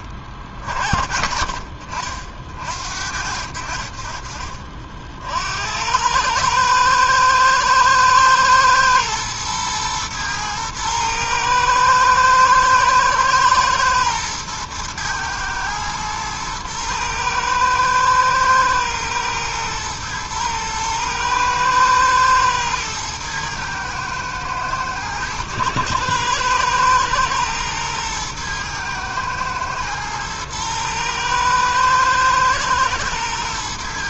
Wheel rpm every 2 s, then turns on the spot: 50, 60, 50, 110, 110, 110, 110, 110, 110, 110, 120, 110, 110, 120, 110, 110, 110.
none